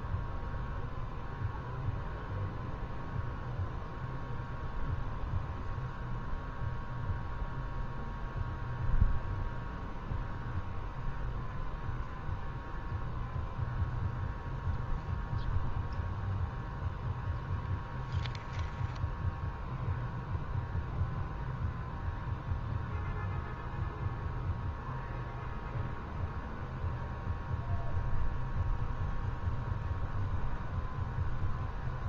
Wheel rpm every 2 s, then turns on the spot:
0, 0, 0, 0, 0, 0, 0, 0, 0, 0, 0, 0, 0, 0, 0, 0.
none